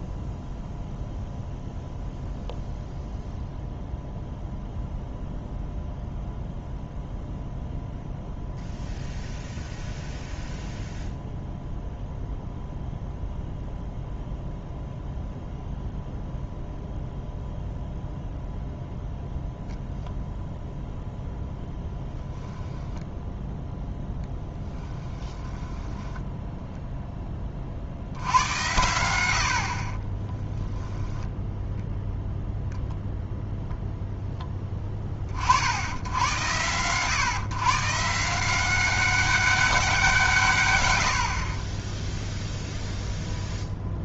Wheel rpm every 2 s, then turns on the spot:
0, 0, 0, 0, 0, 0, 0, 0, 0, 0, 0, 0, 10, 0, 90, 10, 0, 10, 100, 180, 110, 0.
24-26